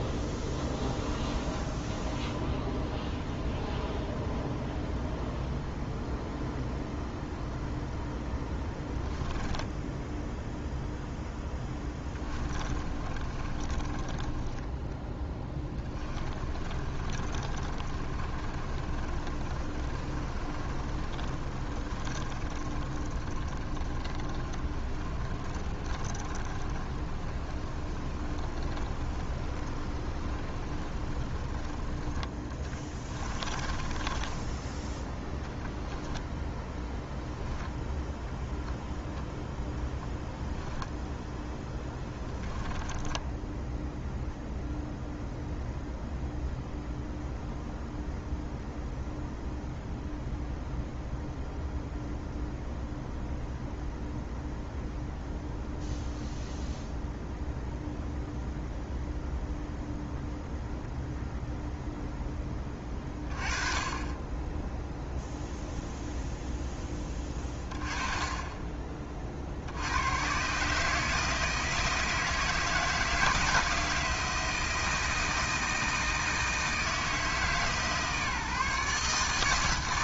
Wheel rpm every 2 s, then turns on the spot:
0, 0, 0, 0, 10, 0, 20, 10, 30, 30, 30, 30, 40, 30, 20, 20, 10, 10, 10, 0, 0, 10, 0, 0, 0, 0, 0, 0, 0, 0, 0, 10, 10, 10, 20, 140, 160, 160, 160, 150.
8-10 12-34 36-38 42-44